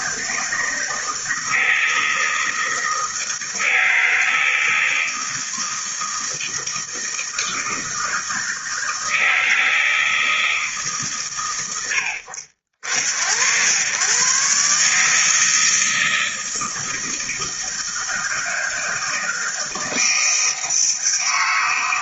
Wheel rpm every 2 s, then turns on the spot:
160, 160, 160, 160, 160, 160, 70, 140, 160, 160, 160.
none